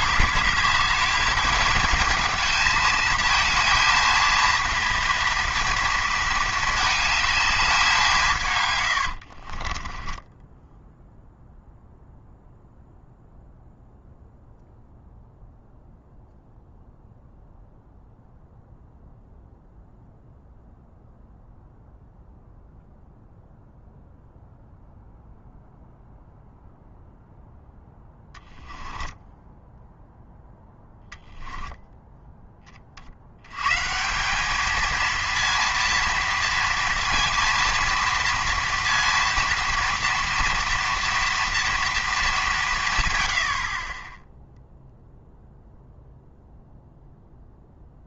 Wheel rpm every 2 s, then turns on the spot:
210, 220, 230, 220, 110, 10, 0, 0, 0, 0, 0, 0, 0, 0, 10, 0, 30, 220, 230, 230, 230, 140, 0, 0.
8-10